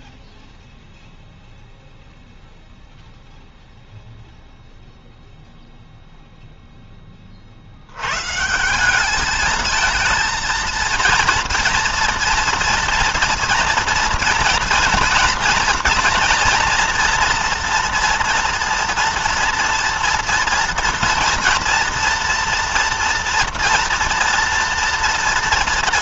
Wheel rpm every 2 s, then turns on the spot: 0, 0, 0, 0, 150, 230, 230, 230, 240, 230, 230, 230, 230.
none